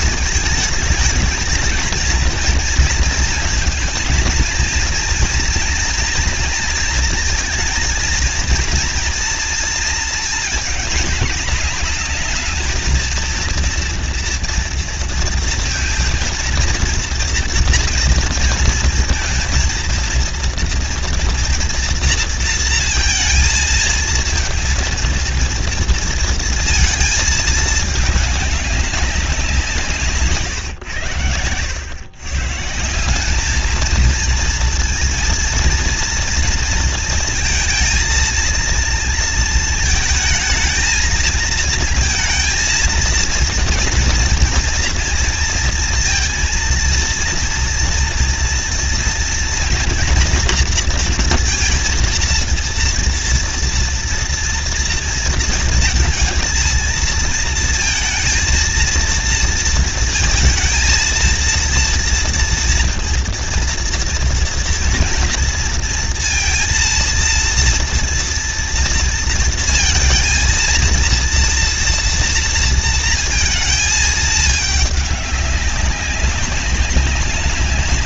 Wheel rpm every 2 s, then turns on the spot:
220, 230, 230, 230, 230, 220, 220, 240, 230, 230, 230, 230, 230, 230, 200, 130, 150, 230, 230, 230, 220, 230, 230, 230, 230, 230, 230, 230, 220, 230, 230, 230, 240, 230, 230, 230, 230, 210, 190.
none